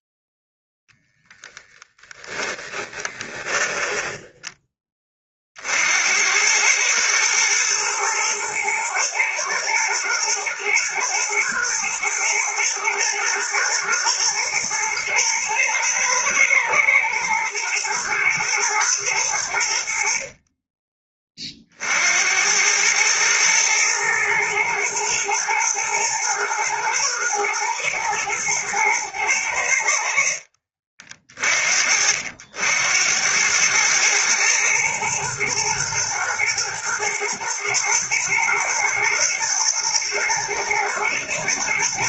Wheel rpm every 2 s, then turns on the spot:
10, 10, 20, 110, 120, 120, 110, 110, 110, 110, 30, 110, 110, 120, 110, 60, 90, 120, 110, 120, 120.
2-4